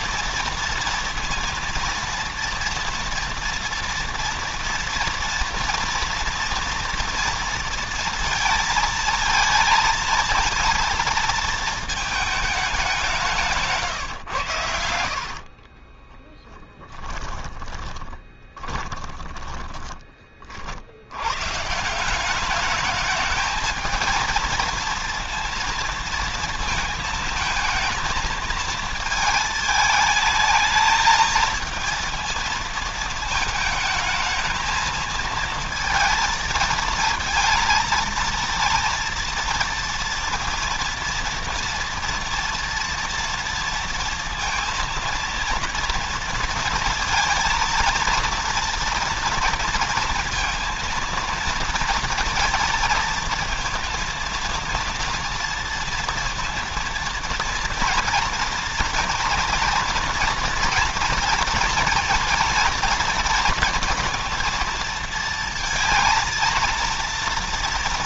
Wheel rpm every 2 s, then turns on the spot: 230, 230, 240, 240, 230, 230, 200, 110, 20, 20, 40, 200, 230, 230, 220, 210, 220, 220, 230, 230, 230, 230, 230, 230, 230, 230, 230, 230, 230, 240, 230, 230, 230, 230.
14-20